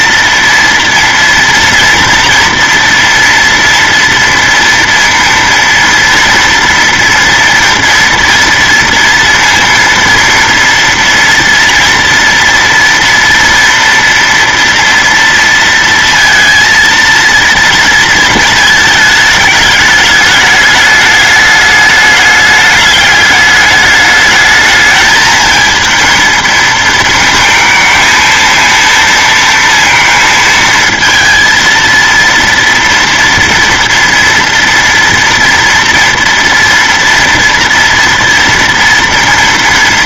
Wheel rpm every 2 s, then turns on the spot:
230, 230, 230, 230, 230, 230, 230, 230, 230, 230, 210, 200, 210, 220, 220, 230, 230, 230, 230, 230.
none